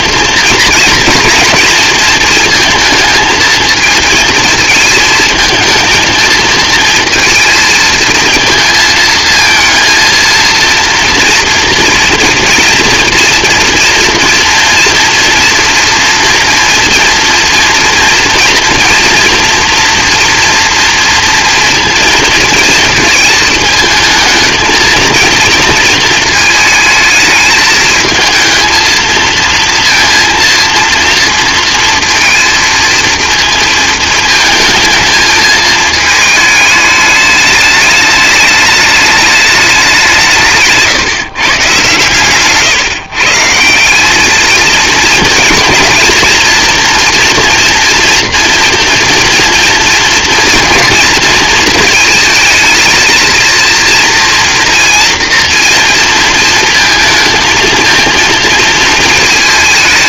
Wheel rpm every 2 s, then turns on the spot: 230, 230, 220, 230, 230, 230, 230, 230, 230, 230, 240, 230, 220, 220, 220, 230, 220, 220, 210, 210, 160, 140, 220, 230, 240, 230, 220, 230, 230, 230.
none